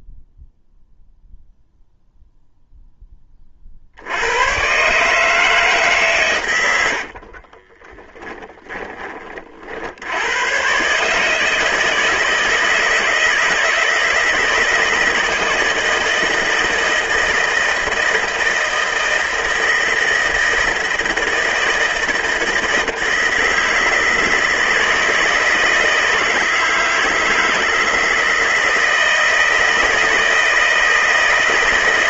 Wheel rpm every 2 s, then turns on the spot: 0, 10, 140, 70, 30, 140, 160, 160, 160, 160, 160, 160, 160, 160, 160, 160.
6-8